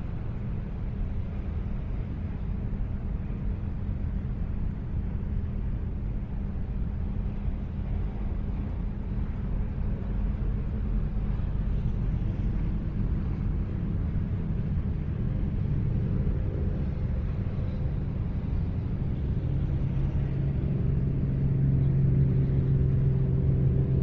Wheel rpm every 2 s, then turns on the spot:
0, 0, 0, 0, 0, 0, 0, 0, 0, 0, 0, 0.
none